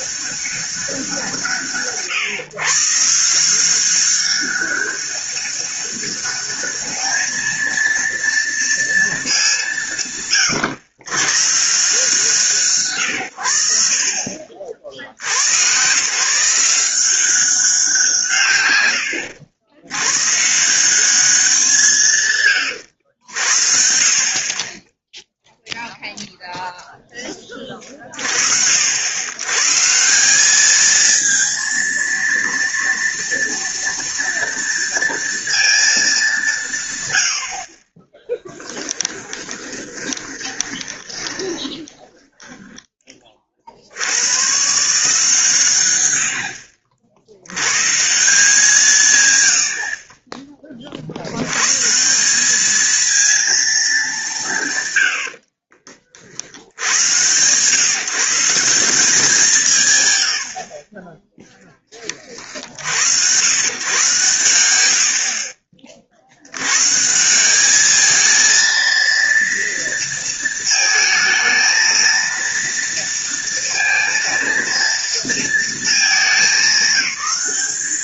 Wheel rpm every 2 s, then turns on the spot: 190, 140, 200, 210, 230, 110, 130, 60, 180, 100, 180, 100, 20, 0, 70, 210, 230, 230, 120, 10, 20, 10, 150, 70, 150, 40, 220, 120, 90, 180, 30, 70, 80, 130, 230, 220, 230, 230, 200.
38-42